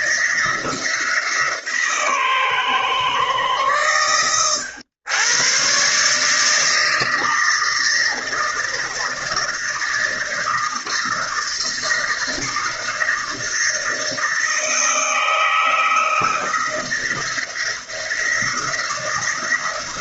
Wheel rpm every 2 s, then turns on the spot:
160, 130, 100, 160, 160, 160, 160, 160, 170, 170.
none